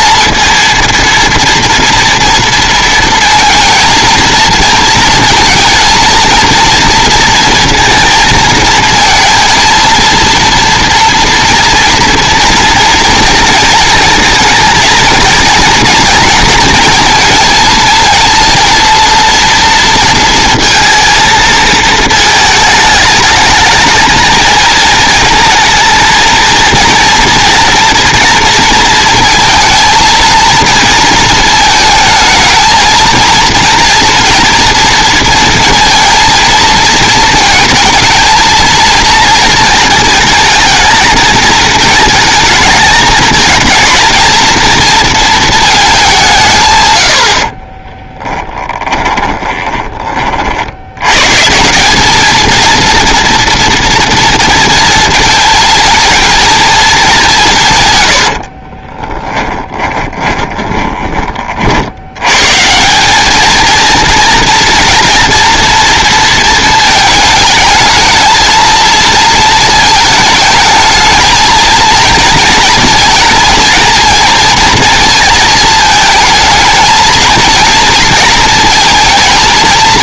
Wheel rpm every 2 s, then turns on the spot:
230, 230, 230, 230, 230, 230, 240, 230, 230, 230, 220, 220, 220, 230, 230, 230, 220, 240, 230, 230, 220, 230, 230, 140, 20, 50, 220, 230, 220, 40, 20, 140, 240, 230, 220, 220, 230, 230, 220, 220.
48-50 58-62